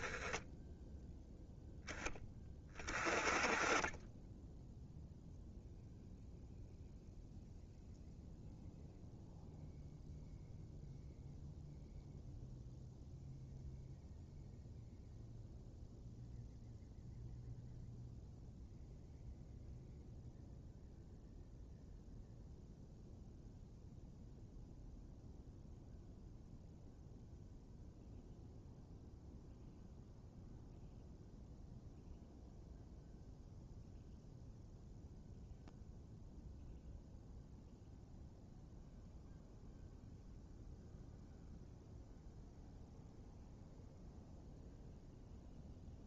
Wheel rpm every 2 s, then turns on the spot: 0, 20, 0, 0, 0, 0, 0, 0, 0, 0, 0, 0, 0, 0, 0, 0, 0, 0, 0, 0, 0, 0, 0.
none